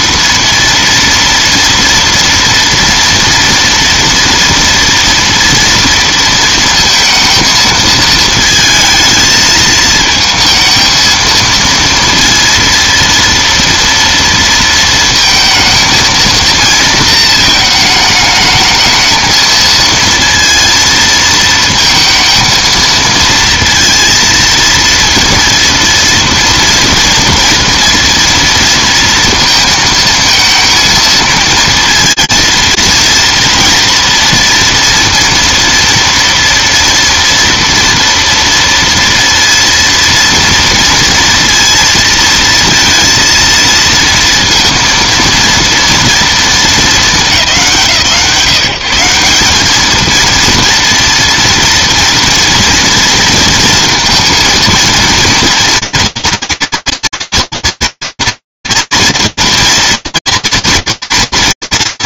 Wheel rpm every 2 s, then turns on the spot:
230, 230, 230, 230, 220, 220, 230, 220, 220, 220, 230, 230, 230, 230, 230, 230, 230, 230, 230, 230, 230, 230, 230, 220, 170, 230, 230, 230, 230, 230, 230.
none